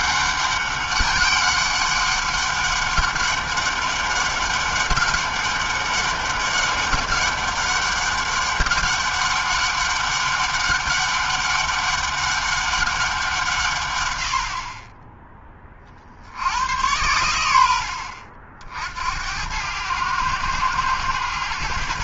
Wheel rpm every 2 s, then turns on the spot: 200, 200, 200, 200, 200, 200, 180, 10, 100, 70, 100.
none